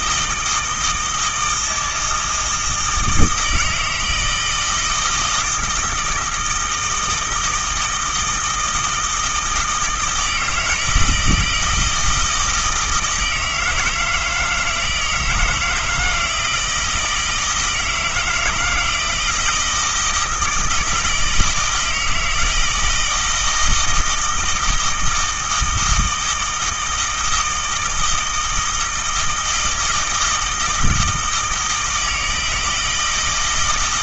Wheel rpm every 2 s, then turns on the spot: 160, 160, 160, 160, 160, 160, 160, 160, 160, 170, 160, 160, 160, 160, 160, 160, 160.
none